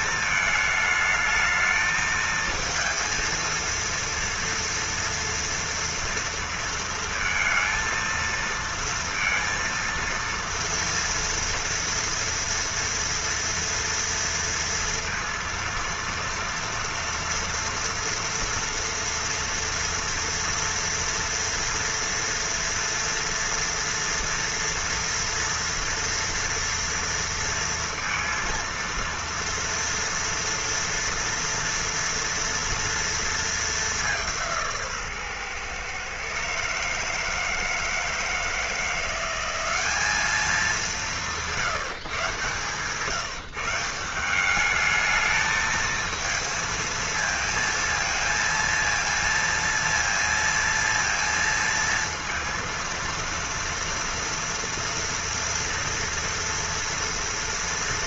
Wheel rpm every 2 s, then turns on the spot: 220, 230, 230, 230, 230, 230, 230, 230, 230, 230, 230, 230, 230, 230, 230, 230, 230, 160, 150, 170, 200, 150, 210, 230, 230, 230, 230, 240, 230.
none